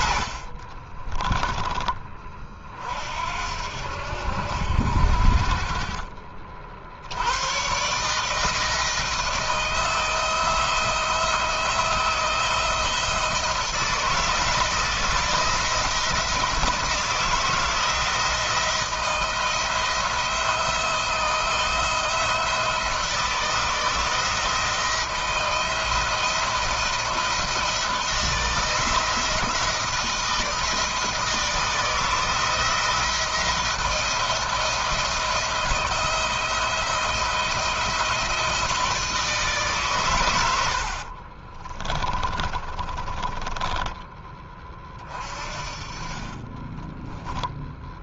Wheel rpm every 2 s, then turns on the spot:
40, 50, 70, 60, 160, 170, 170, 160, 170, 170, 170, 170, 160, 170, 170, 160, 170, 170, 160, 160, 80, 30, 30, 20.
0-2 40-44 46-48